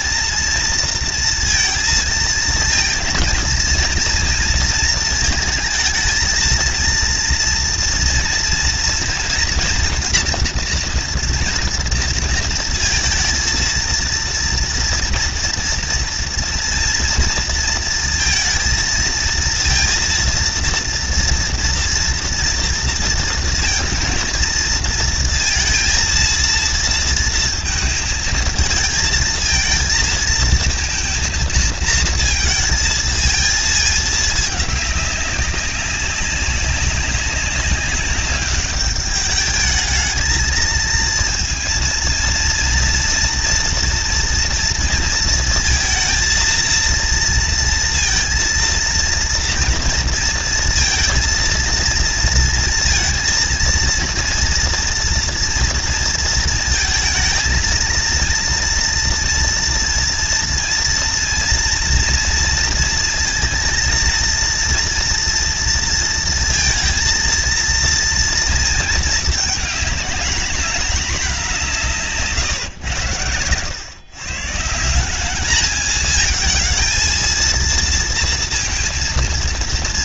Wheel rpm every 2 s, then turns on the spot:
230, 230, 230, 220, 230, 240, 230, 230, 230, 230, 230, 230, 230, 230, 220, 220, 230, 220, 190, 200, 220, 230, 230, 230, 230, 230, 230, 230, 230, 230, 230, 230, 230, 230, 230, 210, 150, 130, 220, 230.
none